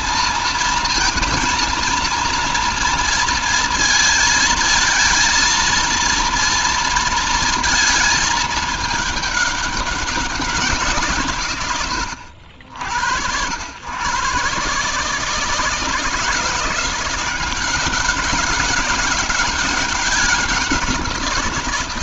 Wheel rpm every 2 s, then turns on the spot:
230, 230, 230, 230, 210, 150, 80, 140, 170, 200, 180.
none